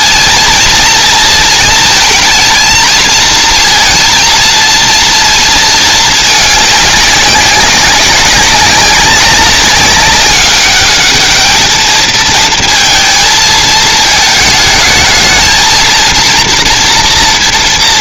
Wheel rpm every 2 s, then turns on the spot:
230, 220, 230, 210, 200, 210, 220, 210, 230.
none